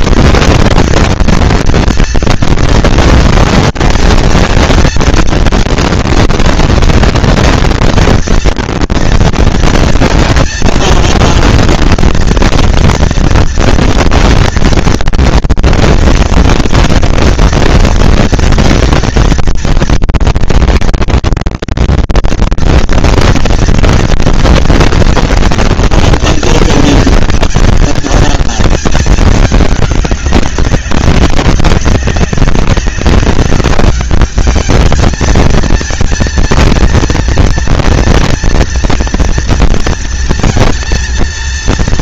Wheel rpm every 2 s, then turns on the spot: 210, 230, 230, 230, 230, 230, 230, 240, 230, 230, 230, 230, 230, 230, 230, 200, 190, 210, 230, 230, 230.
none